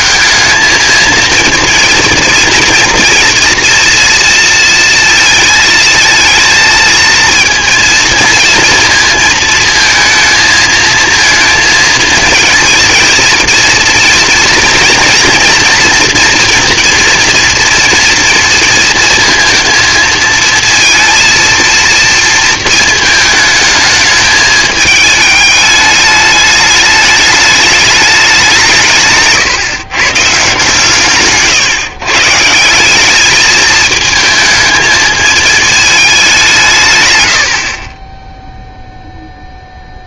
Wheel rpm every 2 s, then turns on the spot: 220, 230, 230, 220, 230, 220, 220, 230, 240, 230, 220, 230, 220, 210, 190, 140, 150, 220, 180, 10.
none